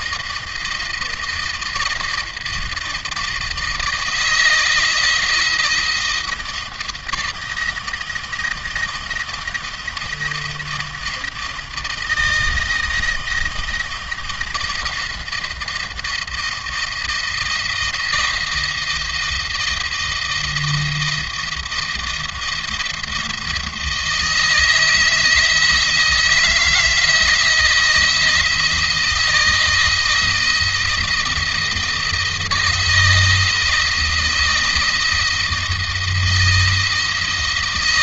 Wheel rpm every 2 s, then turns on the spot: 160, 160, 170, 160, 160, 160, 160, 160, 160, 170, 160, 160, 160, 160, 160, 160, 160, 160, 170.
none